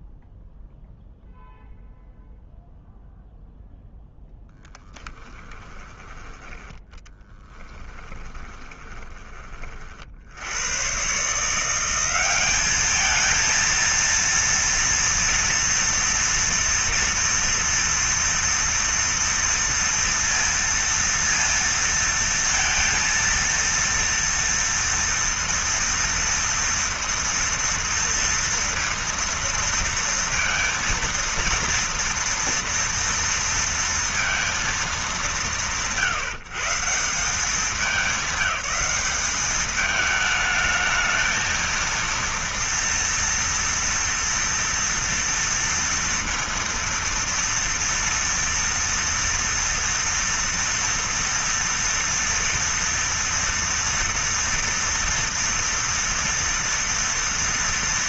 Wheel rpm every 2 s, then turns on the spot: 0, 0, 10, 10, 20, 100, 210, 230, 230, 230, 230, 230, 230, 230, 230, 230, 240, 220, 150, 210, 220, 230, 230, 230, 230, 230, 230, 230, 230.
6-10